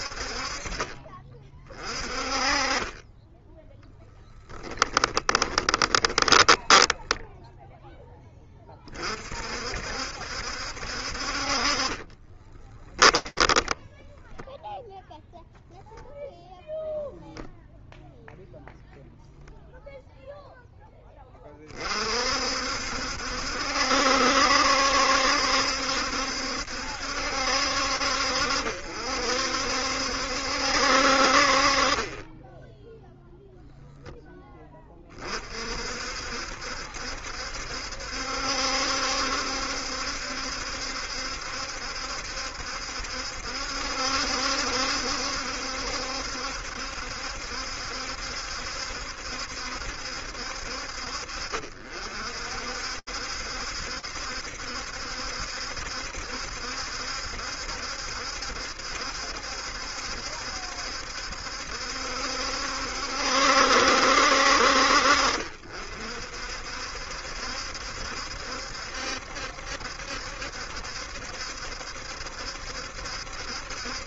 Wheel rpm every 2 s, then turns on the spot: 30, 10, 10, 0, 50, 50, 10, 0, 0, 0, 10, 70, 70, 70, 60, 50, 0, 30, 70, 70, 70, 70, 70, 70, 70, 60, 60, 70, 70, 70, 70, 70, 60, 60, 70, 70, 70.
2-6 12-14